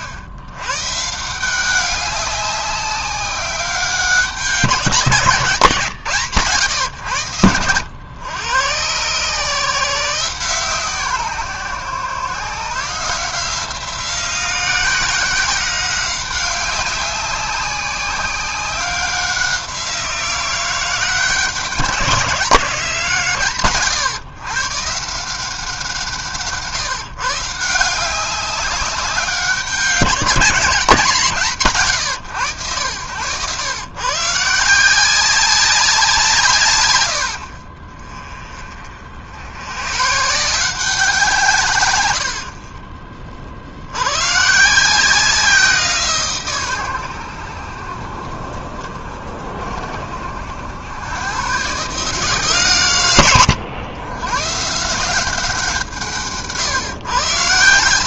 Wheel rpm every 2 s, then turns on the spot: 100, 190, 190, 140, 110, 150, 150, 180, 190, 190, 170, 180, 140, 150, 200, 190, 90, 170, 120, 40, 170, 50, 150, 120, 50, 90, 130, 140, 140.
none